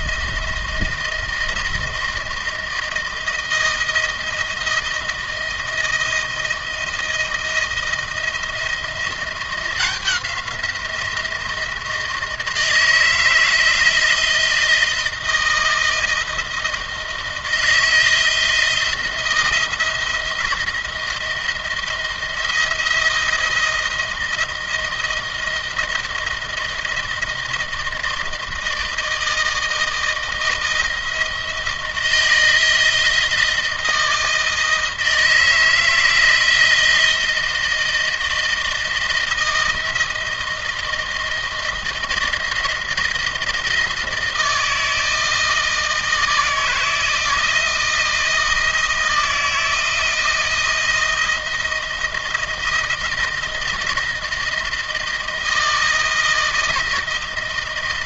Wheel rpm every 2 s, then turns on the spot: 170, 160, 170, 160, 170, 170, 160, 170, 160, 170, 170, 160, 160, 160, 160, 170, 170, 160, 160, 160, 160, 160, 160, 160, 160, 160, 160, 160, 160.
none